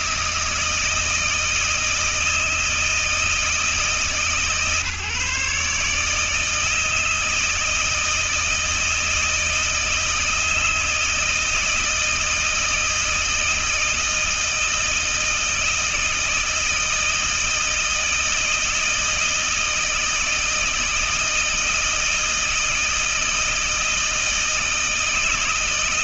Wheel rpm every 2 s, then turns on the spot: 160, 160, 150, 160, 160, 160, 160, 160, 160, 160, 160, 160, 160.
none